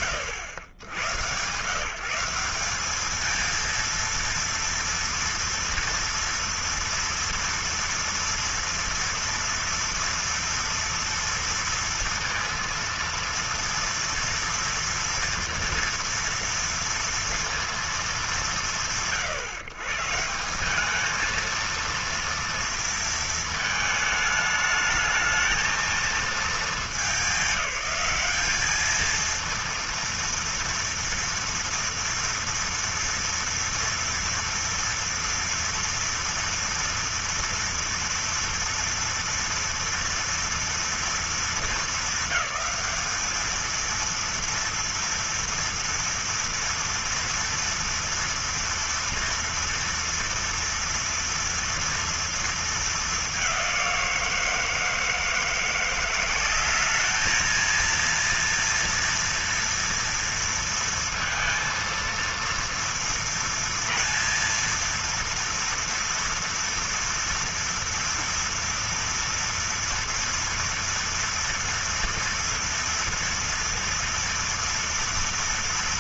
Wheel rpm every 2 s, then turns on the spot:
100, 210, 230, 230, 240, 230, 230, 230, 230, 130, 200, 230, 220, 210, 220, 240, 230, 240, 230, 240, 220, 210, 230, 230, 230, 230, 210, 160, 210, 240, 230, 230, 230, 230, 230, 240, 230, 230.
none